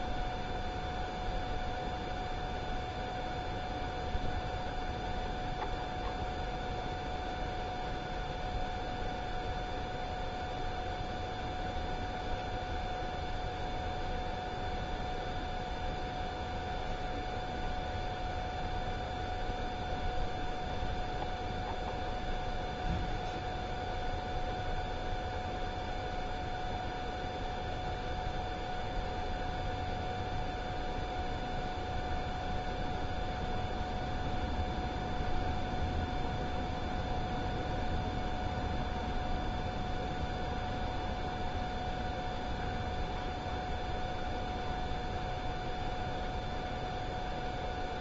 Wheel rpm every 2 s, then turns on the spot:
0, 0, 0, 0, 0, 0, 0, 0, 0, 0, 0, 0, 0, 0, 0, 0, 0, 0, 0, 0, 0, 0, 0, 0.
none